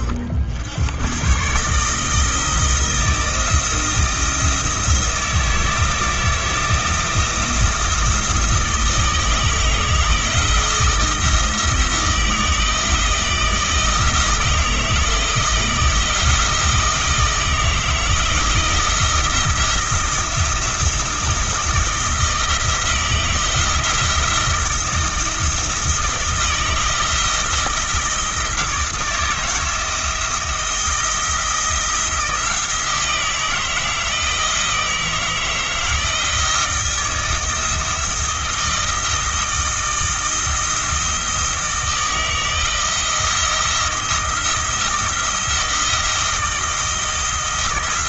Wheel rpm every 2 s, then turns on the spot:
90, 160, 160, 160, 160, 160, 160, 160, 160, 170, 170, 160, 170, 160, 160, 170, 160, 160, 160, 160, 160, 160, 170, 160.
none